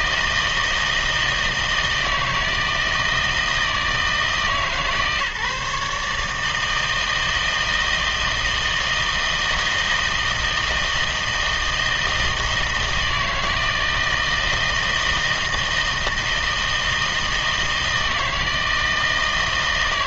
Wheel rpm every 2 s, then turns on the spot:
160, 160, 150, 160, 160, 160, 160, 160, 160, 160.
none